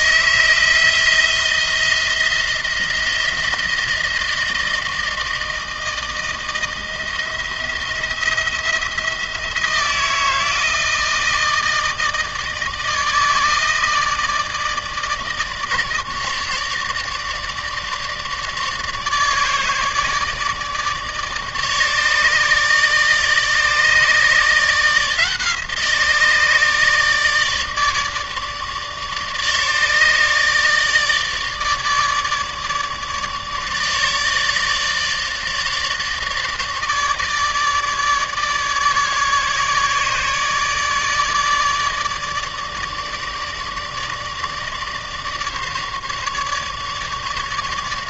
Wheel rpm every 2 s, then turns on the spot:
170, 170, 160, 160, 170, 160, 160, 150, 150, 150, 150, 150, 160, 150, 150, 150, 150, 150, 150, 150, 150, 150, 150, 150.
none